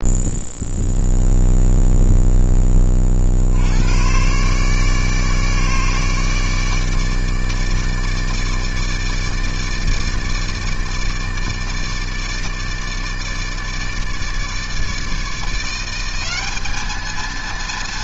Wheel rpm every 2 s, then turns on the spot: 0, 20, 150, 150, 160, 150, 160, 150, 210.
none